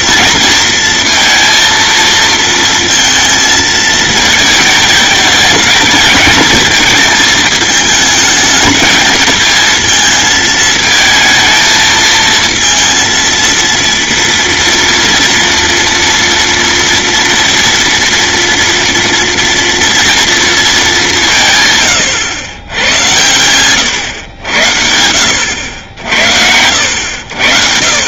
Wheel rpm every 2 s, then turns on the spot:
230, 230, 220, 220, 220, 220, 230, 230, 230, 230, 230, 110, 90, 80.
none